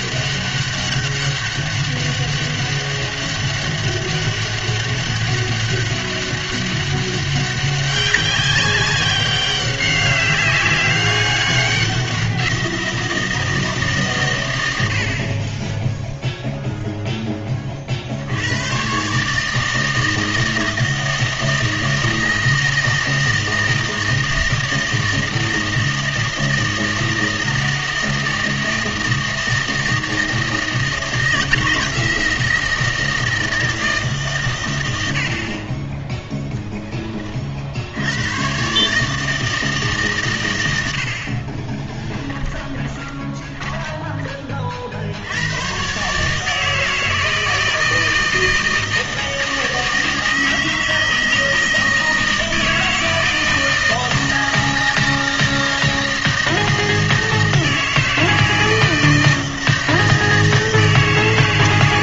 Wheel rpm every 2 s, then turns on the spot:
200, 200, 200, 200, 190, 190, 170, 100, 0, 110, 160, 160, 160, 160, 160, 160, 160, 110, 10, 130, 90, 20, 40, 160, 160, 160, 160, 160, 160, 160, 160.
42-44